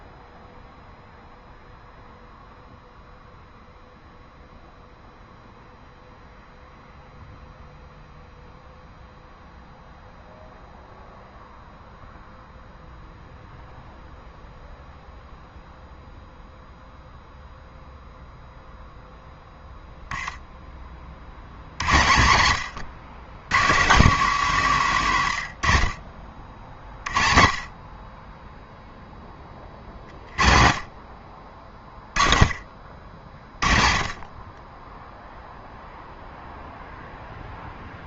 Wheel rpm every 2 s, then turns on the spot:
0, 0, 0, 0, 0, 0, 0, 0, 0, 0, 20, 110, 170, 50, 0, 50, 40, 20, 0.
none